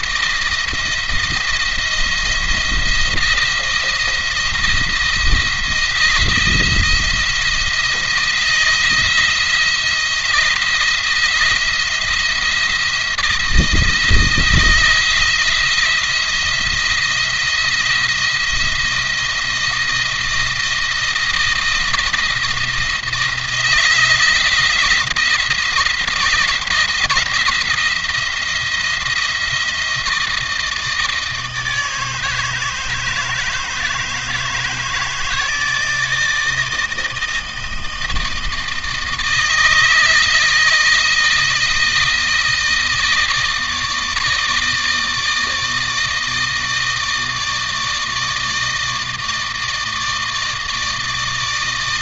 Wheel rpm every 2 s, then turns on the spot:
170, 160, 160, 170, 170, 170, 170, 170, 160, 170, 160, 160, 170, 160, 170, 160, 160, 160, 160, 160, 160, 160, 160, 160, 160, 160.
none